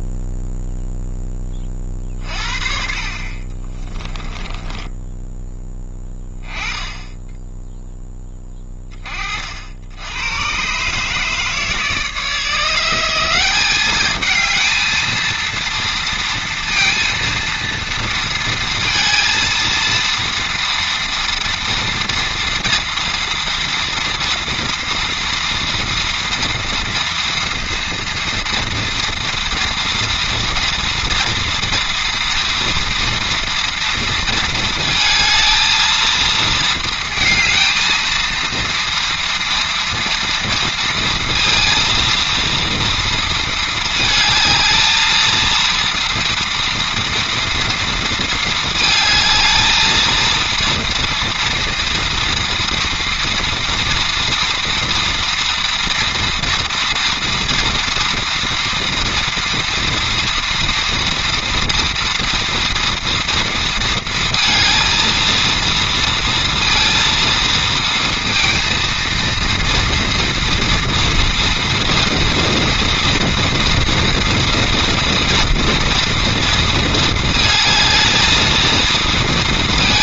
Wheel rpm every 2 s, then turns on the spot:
10, 50, 10, 10, 20, 140, 170, 220, 230, 230, 230, 230, 230, 230, 230, 240, 230, 220, 230, 230, 230, 230, 220, 240, 220, 230, 230, 230, 230, 230, 230, 230, 230, 230, 230, 230, 230, 230, 220, 230.
4-6